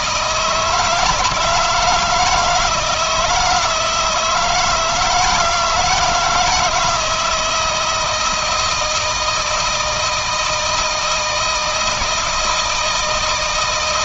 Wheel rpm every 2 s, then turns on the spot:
160, 160, 160, 160, 170, 160, 160.
none